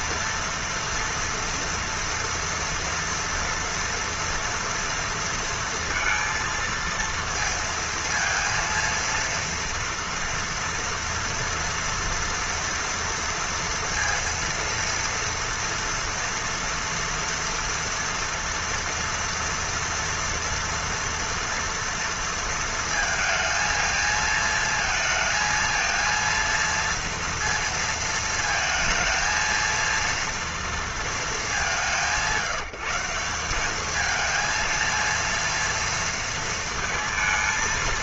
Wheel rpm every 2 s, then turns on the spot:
230, 230, 240, 230, 230, 230, 230, 230, 230, 230, 230, 230, 220, 230, 230, 230, 160, 220, 230.
none